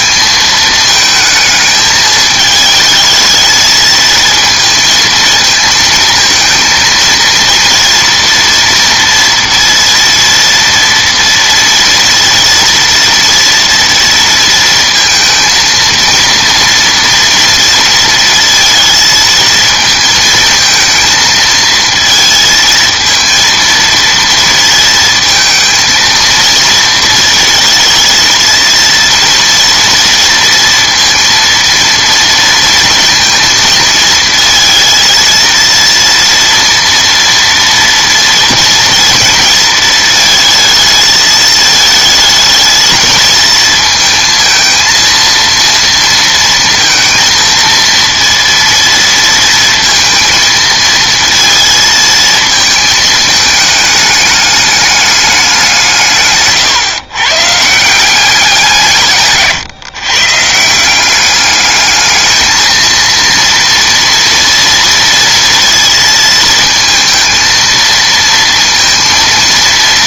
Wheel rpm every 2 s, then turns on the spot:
220, 220, 220, 230, 240, 230, 230, 230, 230, 230, 220, 220, 230, 230, 230, 230, 230, 220, 230, 230, 220, 220, 230, 230, 230, 230, 220, 210, 140, 180, 160, 220, 230, 230, 230.
none